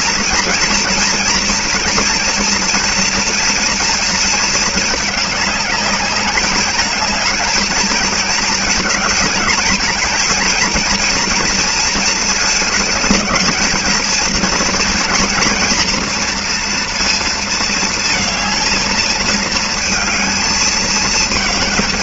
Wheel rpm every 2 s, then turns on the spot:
230, 240, 220, 210, 230, 230, 220, 230, 230, 220, 220.
none